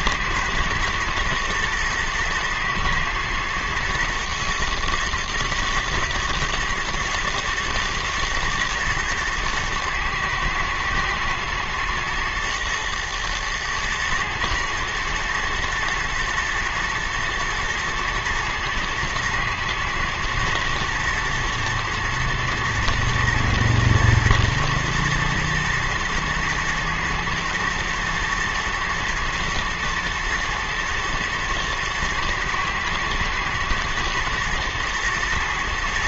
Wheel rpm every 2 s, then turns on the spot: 120, 110, 110, 110, 110, 120, 110, 110, 110, 110, 120, 120, 120, 110, 120, 110, 110, 120.
none